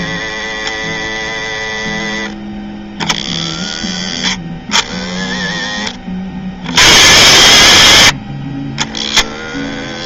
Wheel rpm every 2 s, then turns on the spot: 120, 60, 70, 70, 60.
none